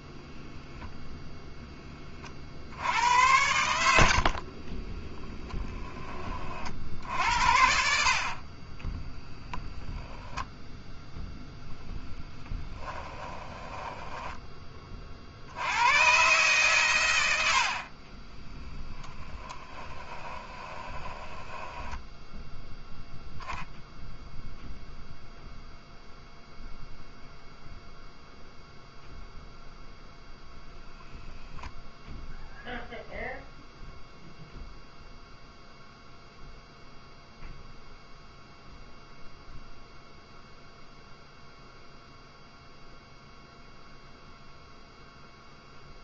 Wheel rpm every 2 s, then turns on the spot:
0, 70, 20, 60, 30, 10, 10, 30, 120, 20, 20, 0, 0, 0, 0, 0, 0, 0, 0, 0, 0, 0, 0.
4-6 8-10 12-14 18-22